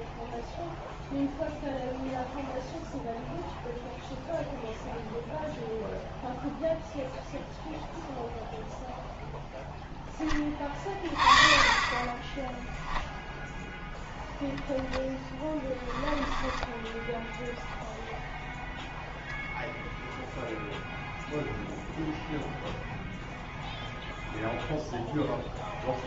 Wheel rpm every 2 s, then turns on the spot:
0, 0, 0, 0, 0, 20, 10, 0, 10, 0, 0, 0, 0.
12-14 16-18